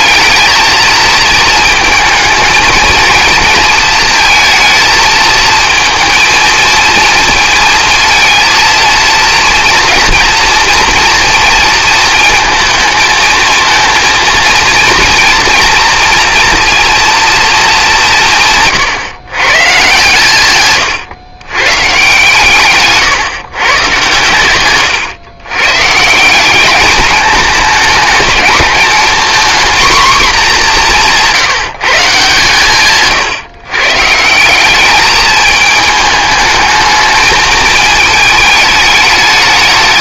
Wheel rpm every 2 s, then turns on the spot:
220, 230, 220, 230, 230, 230, 220, 230, 230, 170, 130, 150, 120, 190, 220, 220, 140, 180, 210, 220.
none